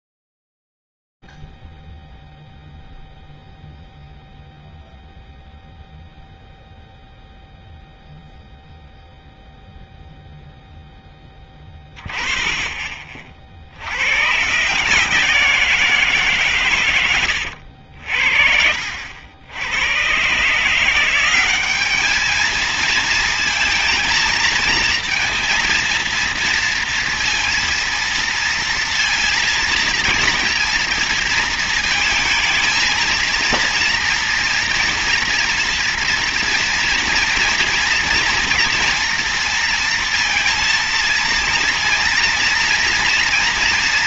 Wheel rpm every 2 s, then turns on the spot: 0, 0, 0, 0, 0, 10, 40, 160, 130, 70, 180, 230, 230, 230, 230, 230, 230, 230, 240, 230, 230, 230.
16-18